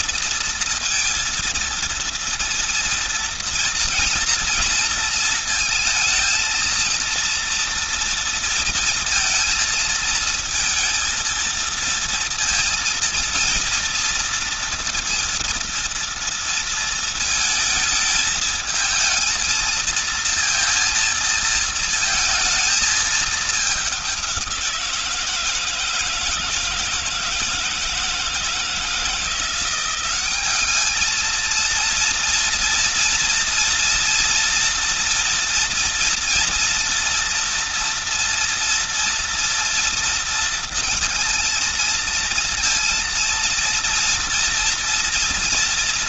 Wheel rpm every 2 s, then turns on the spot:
230, 230, 230, 230, 230, 220, 230, 230, 230, 220, 230, 220, 180, 160, 160, 200, 230, 230, 230, 230, 230, 230, 230.
none